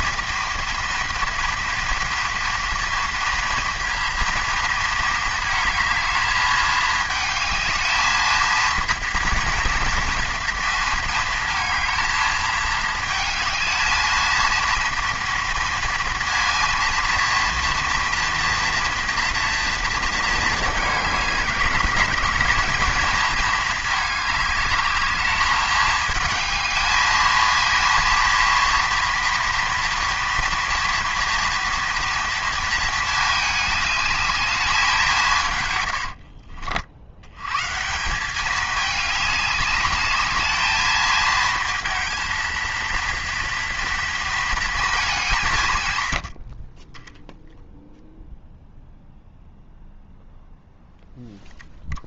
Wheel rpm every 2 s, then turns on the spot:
230, 230, 230, 220, 230, 230, 220, 230, 230, 230, 210, 230, 210, 220, 230, 230, 220, 200, 60, 200, 220, 230, 220, 30, 0, 0.
none